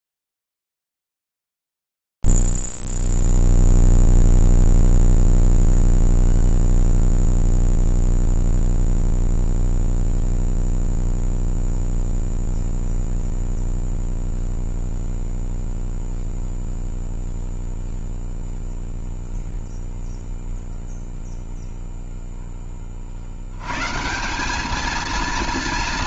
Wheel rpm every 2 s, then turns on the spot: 0, 0, 0, 0, 0, 0, 0, 0, 0, 0, 0, 10, 180.
none